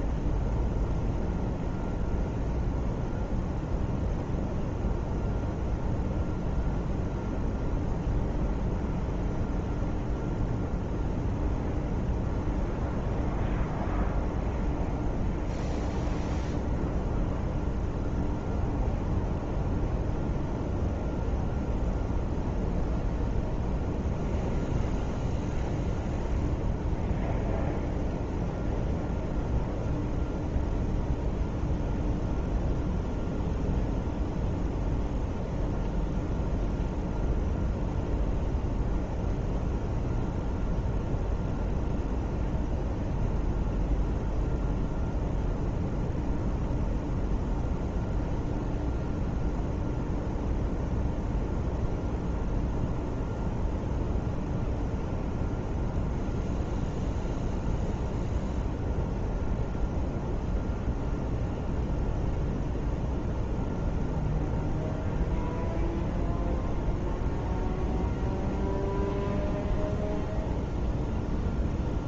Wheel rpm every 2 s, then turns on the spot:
0, 0, 0, 0, 0, 0, 0, 0, 0, 0, 0, 0, 0, 0, 0, 0, 0, 0, 0, 0, 0, 0, 0, 0, 0, 0, 0, 0, 0, 0, 0, 0, 0, 0, 0, 0.
none